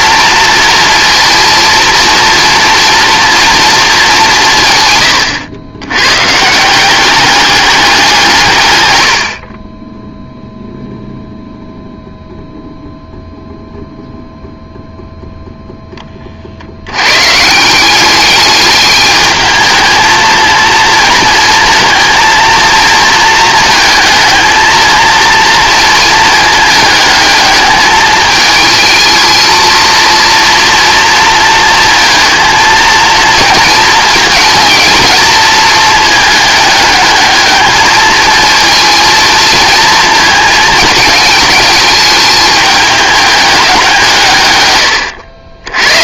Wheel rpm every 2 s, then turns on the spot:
230, 230, 160, 160, 120, 0, 0, 0, 80, 210, 230, 230, 220, 220, 220, 230, 220, 220, 210, 220, 220, 210, 110.
none